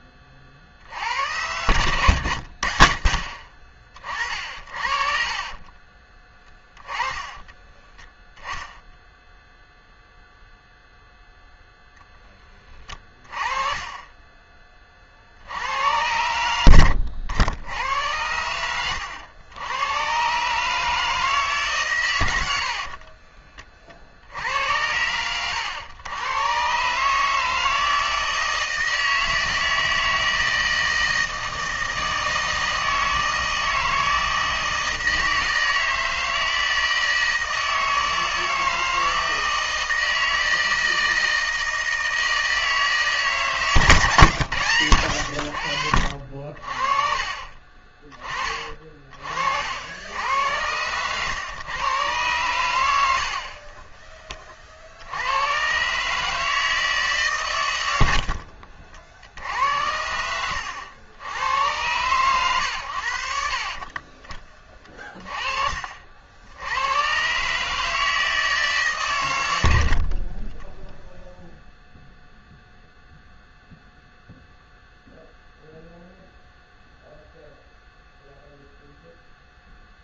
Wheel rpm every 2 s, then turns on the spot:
70, 60, 50, 10, 0, 0, 20, 40, 70, 100, 150, 40, 90, 130, 160, 160, 160, 160, 160, 160, 160, 150, 90, 50, 40, 120, 80, 60, 150, 60, 90, 90, 30, 110, 130, 0, 0, 0, 0, 0.
4-8 18-20 22-24